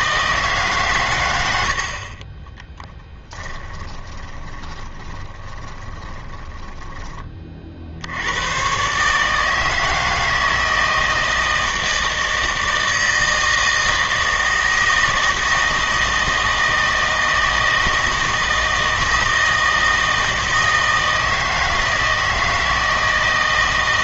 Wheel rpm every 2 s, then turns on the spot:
140, 10, 20, 10, 120, 160, 160, 160, 160, 160, 160, 160.
2-8